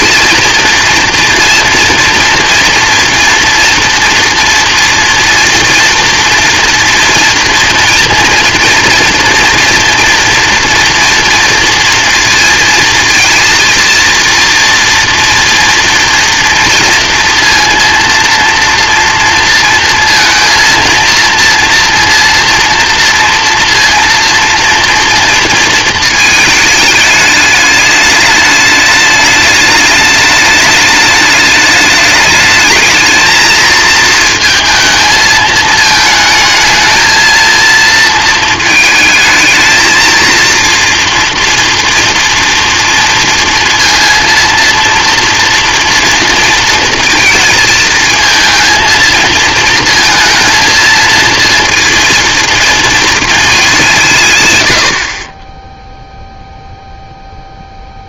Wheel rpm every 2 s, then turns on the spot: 230, 230, 230, 240, 230, 230, 230, 230, 230, 230, 230, 230, 230, 210, 210, 210, 220, 220, 220, 220, 230, 230, 230, 230, 230, 230, 230, 100, 0.
none